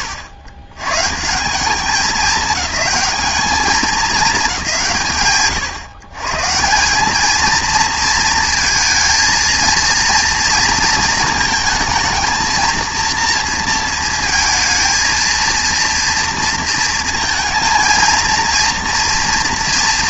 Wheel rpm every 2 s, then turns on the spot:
110, 210, 130, 210, 220, 230, 230, 230, 230, 240.
none